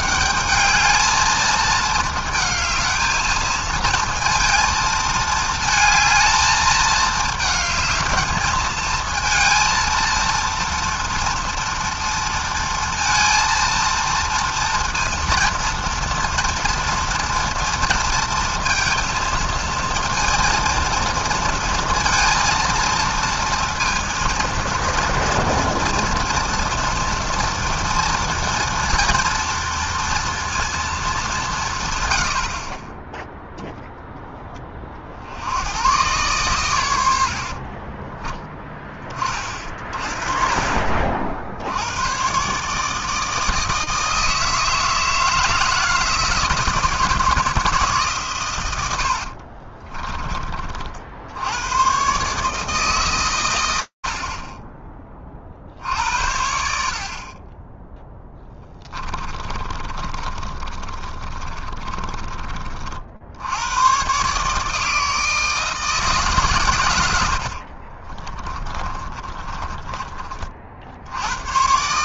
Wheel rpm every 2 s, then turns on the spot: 210, 220, 220, 220, 230, 230, 230, 230, 230, 230, 230, 230, 230, 230, 230, 230, 70, 10, 110, 20, 40, 130, 160, 160, 120, 40, 140, 30, 70, 10, 40, 30, 150, 130, 30, 40.
58-62 68-70